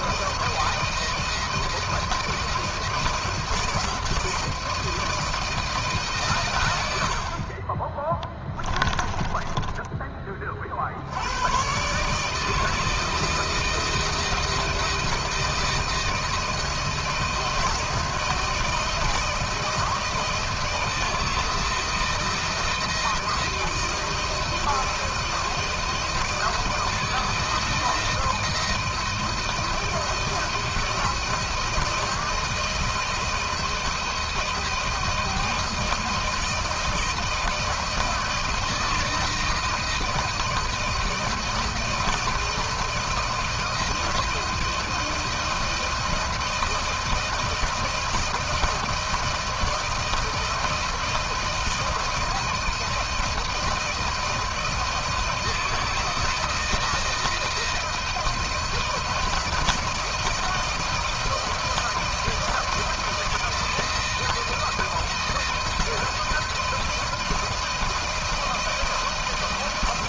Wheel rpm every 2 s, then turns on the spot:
170, 160, 160, 70, 10, 70, 160, 160, 160, 160, 160, 160, 160, 160, 160, 160, 160, 160, 160, 170, 170, 170, 160, 170, 170, 170, 160, 160, 160, 160, 170, 160, 160, 160, 160.
6-10